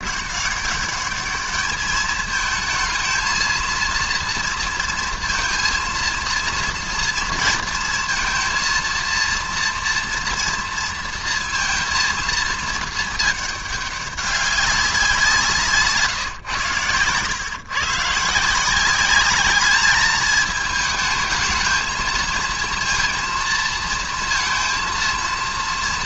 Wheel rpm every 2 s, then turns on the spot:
200, 220, 230, 230, 230, 230, 220, 200, 120, 160, 220, 230, 230.
none